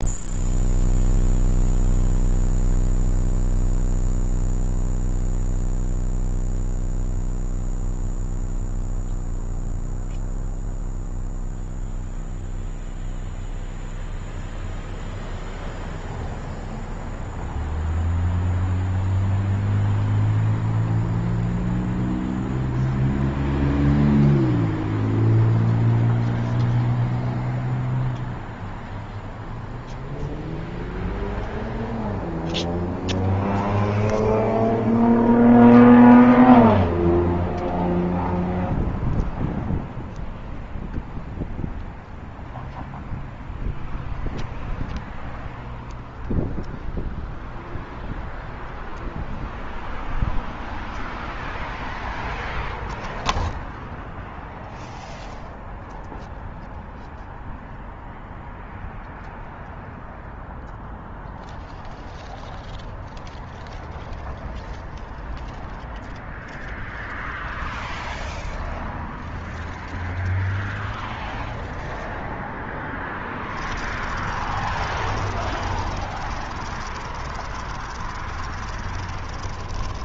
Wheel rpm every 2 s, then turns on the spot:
0, 0, 0, 0, 0, 0, 0, 0, 0, 0, 0, 0, 0, 0, 0, 0, 0, 0, 0, 0, 0, 0, 0, 0, 0, 0, 0, 0, 0, 0, 0, 0, 0, 0, 0, 0, 20, 40, 30, 30.
72-80